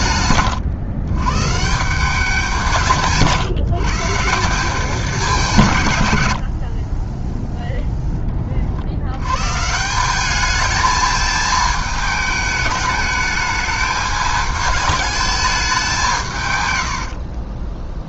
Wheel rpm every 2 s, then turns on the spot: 120, 170, 190, 50, 40, 210, 210, 210, 120.
16-18